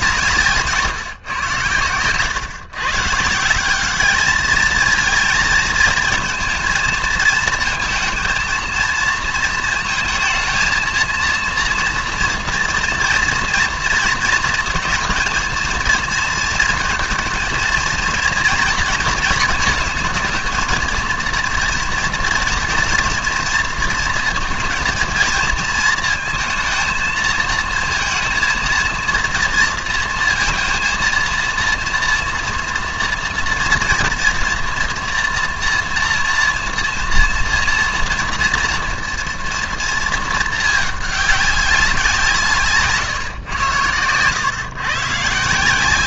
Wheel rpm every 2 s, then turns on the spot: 160, 130, 220, 230, 230, 230, 230, 220, 230, 230, 230, 230, 230, 230, 230, 230, 240, 240, 230, 230, 220, 150, 130.
none